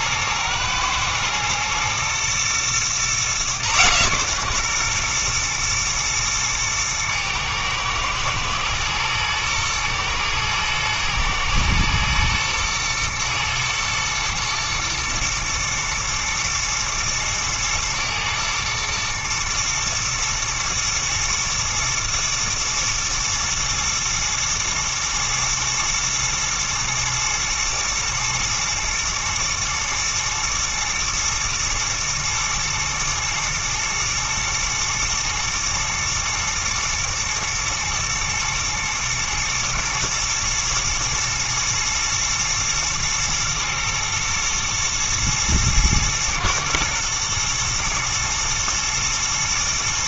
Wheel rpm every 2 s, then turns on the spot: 120, 120, 120, 110, 110, 110, 110, 110, 110, 110, 110, 110, 110, 110, 120, 110, 110, 120, 120, 110, 120, 110, 110, 110, 110.
none